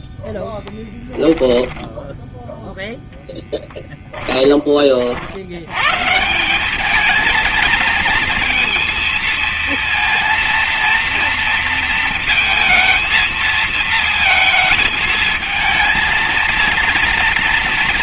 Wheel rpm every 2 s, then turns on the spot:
10, 0, 40, 210, 230, 230, 220, 230, 230.
0-2